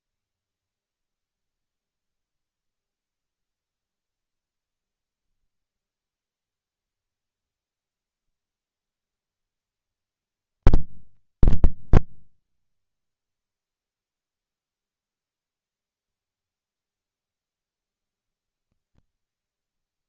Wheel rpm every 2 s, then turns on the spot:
60, 0, 10, 60, 60, 50, 50, 0, 40, 60.
none